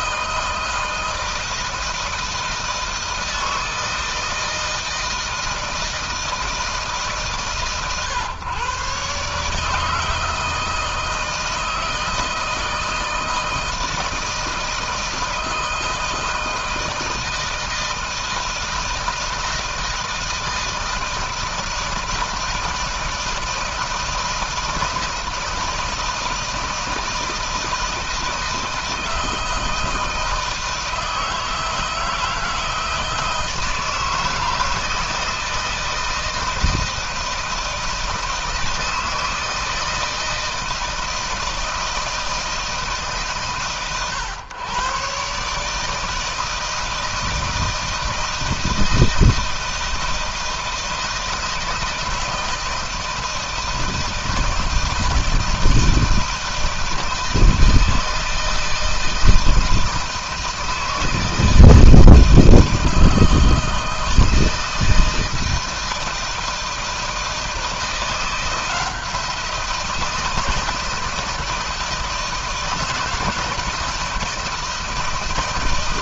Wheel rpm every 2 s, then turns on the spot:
160, 160, 160, 160, 140, 160, 160, 160, 160, 160, 160, 160, 160, 160, 160, 160, 160, 160, 160, 160, 160, 150, 120, 160, 160, 160, 160, 160, 160, 160, 160, 160, 160, 160, 170, 160, 160, 160.
none